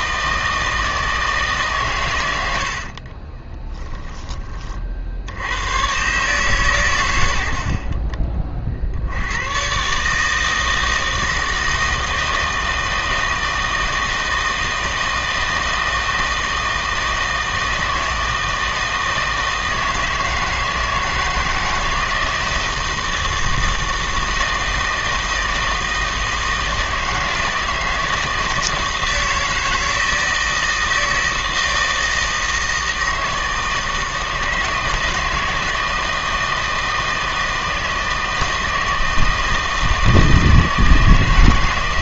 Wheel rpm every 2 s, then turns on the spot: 160, 60, 40, 110, 60, 160, 160, 160, 160, 160, 160, 160, 160, 160, 160, 160, 160, 160, 160, 160, 160.
2-4